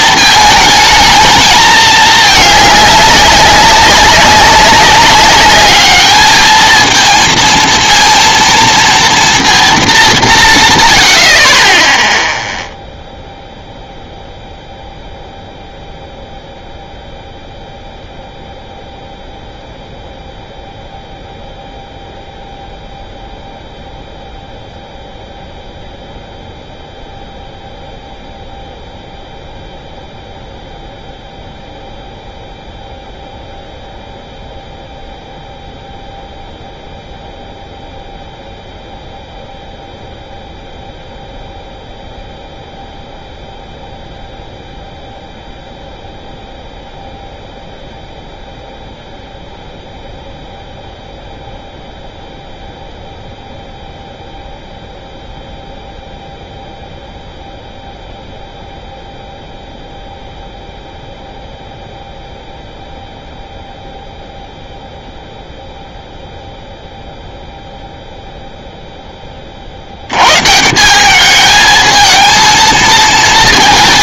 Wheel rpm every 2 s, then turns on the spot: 220, 210, 190, 220, 230, 150, 0, 0, 0, 0, 0, 0, 0, 0, 0, 0, 0, 0, 0, 0, 0, 0, 0, 0, 0, 0, 0, 0, 0, 0, 0, 0, 0, 0, 0, 150, 220.
none